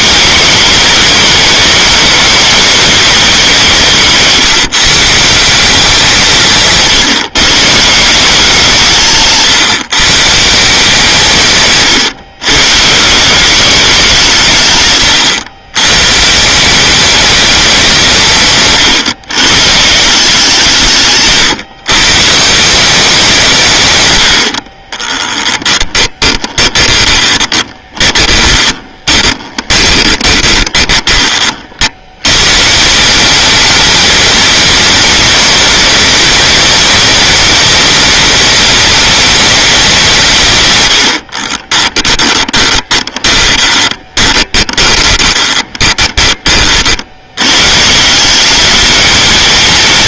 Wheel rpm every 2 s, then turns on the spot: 210, 210, 160, 160, 170, 160, 130, 140, 160, 150, 160, 160, 70, 20, 20, 20, 130, 210, 210, 210, 140, 10, 20, 30, 200.
26-32 42-46